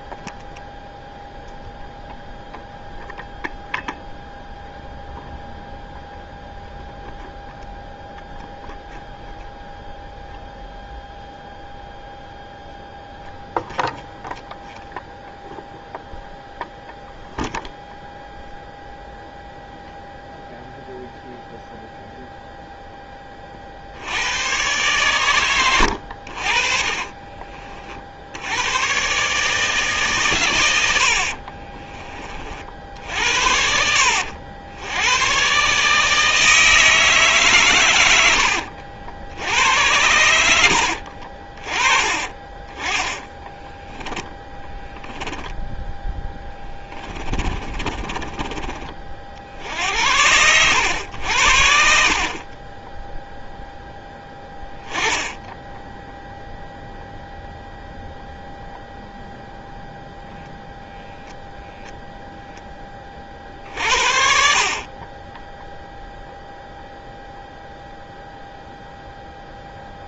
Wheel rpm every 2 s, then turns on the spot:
0, 0, 0, 0, 0, 0, 0, 0, 0, 0, 0, 0, 120, 50, 110, 100, 50, 80, 160, 80, 80, 20, 10, 20, 40, 90, 20, 10, 0, 0, 0, 10, 40, 0, 0.
26-28 40-42 44-48